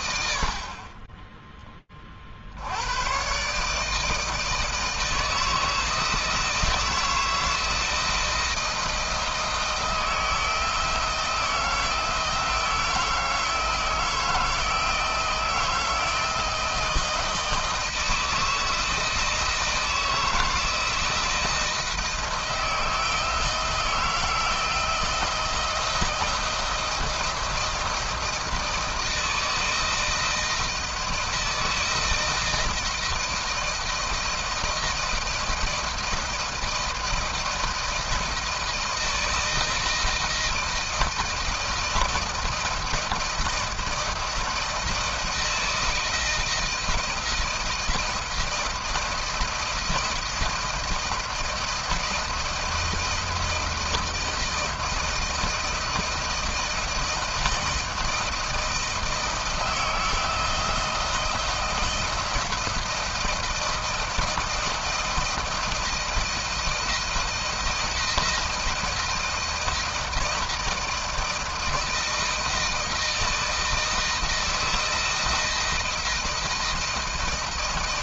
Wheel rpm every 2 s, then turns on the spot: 40, 110, 160, 160, 160, 160, 160, 160, 160, 170, 160, 160, 160, 160, 160, 170, 160, 170, 160, 160, 160, 170, 160, 160, 160, 170, 170, 160, 160, 170, 160, 170, 160, 160, 160, 160, 160, 160, 160.
none